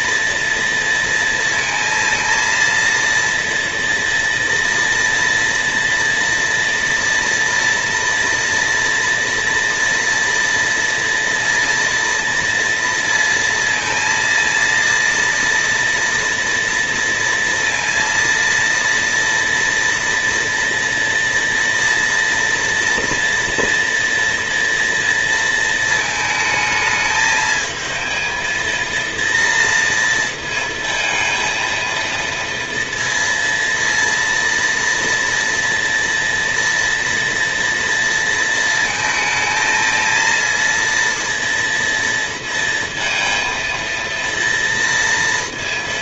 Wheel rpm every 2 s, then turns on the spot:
230, 230, 230, 230, 230, 230, 230, 230, 230, 230, 230, 240, 230, 220, 230, 230, 230, 230, 230, 220, 230, 230, 230.
none